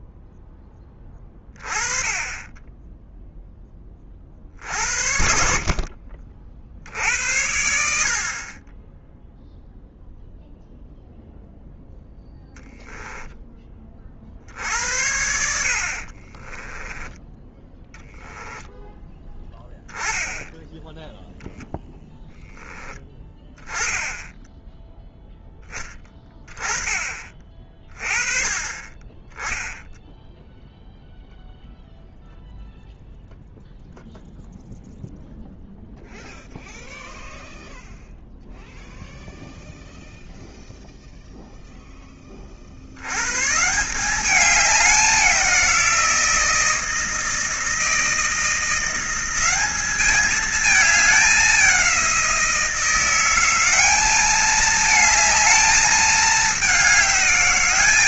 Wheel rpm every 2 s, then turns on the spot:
10, 10, 60, 60, 20, 0, 0, 70, 10, 10, 10, 10, 10, 30, 30, 0, 0, 0, 0, 0, 0, 60, 200, 160, 180, 210, 170, 220, 200.
16-18